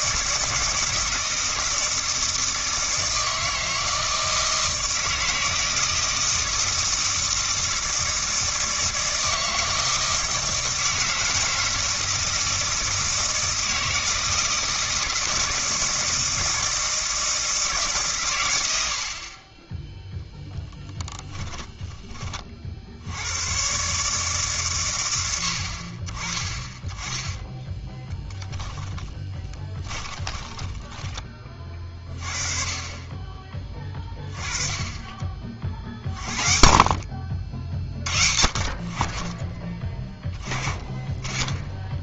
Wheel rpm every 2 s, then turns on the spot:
160, 160, 160, 160, 160, 160, 160, 160, 160, 80, 20, 60, 120, 20, 20, 20, 30, 20, 50, 50, 20.
20-22 28-32